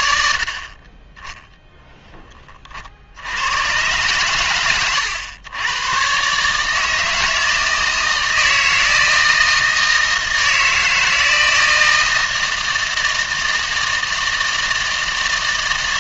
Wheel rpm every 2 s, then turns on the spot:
40, 40, 110, 150, 160, 160, 160, 160.
none